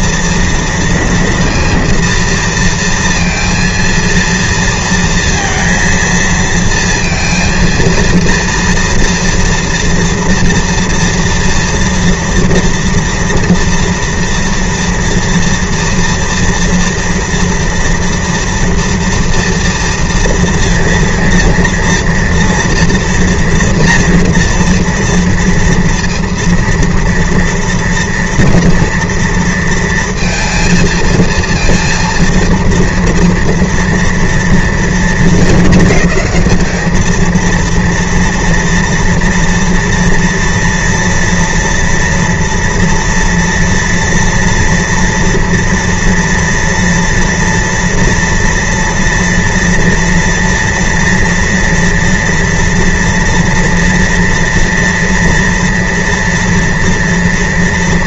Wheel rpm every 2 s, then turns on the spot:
230, 230, 230, 230, 230, 240, 230, 230, 230, 230, 230, 230, 230, 230, 230, 230, 230, 230, 210, 230, 230, 230, 230, 230, 230, 230, 230, 230, 240.
none